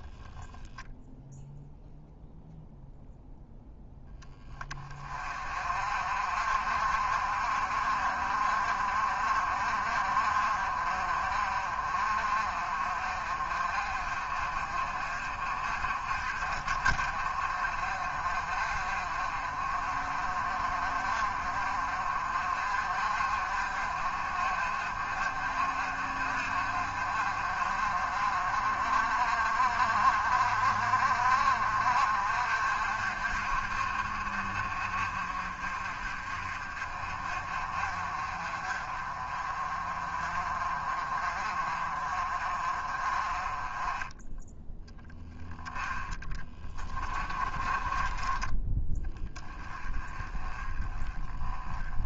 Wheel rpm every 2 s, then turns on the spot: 0, 0, 30, 50, 50, 40, 40, 40, 40, 40, 40, 50, 50, 50, 50, 50, 50, 40, 40, 40, 40, 30, 10, 20, 10, 20.
46-48